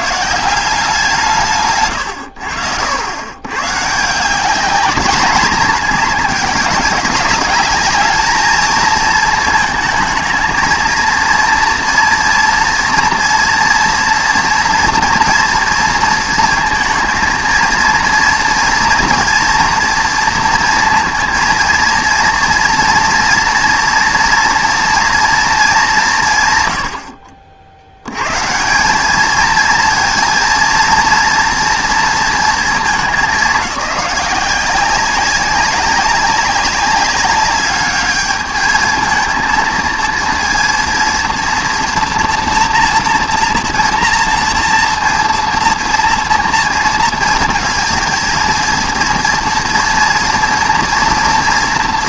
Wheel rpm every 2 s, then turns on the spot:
180, 90, 200, 200, 220, 230, 230, 230, 230, 230, 230, 230, 240, 110, 160, 230, 210, 180, 200, 220, 230, 240, 230, 230, 230, 230.
none